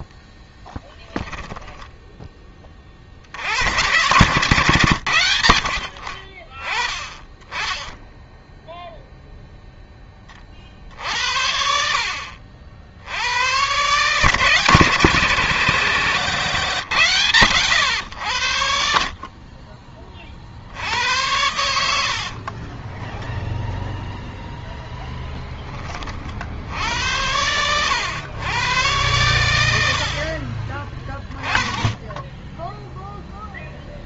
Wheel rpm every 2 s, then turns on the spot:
10, 20, 130, 40, 0, 40, 60, 140, 130, 80, 50, 50, 0, 50, 110, 40, 10.
22-24